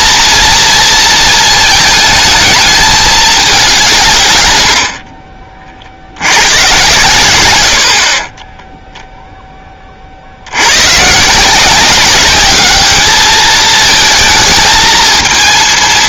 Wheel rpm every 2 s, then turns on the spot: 230, 220, 100, 120, 20, 90, 200, 220.
8-10